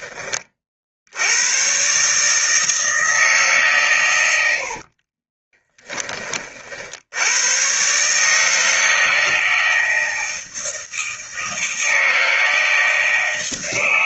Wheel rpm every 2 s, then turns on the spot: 50, 160, 50, 60, 160, 160, 160.
4-6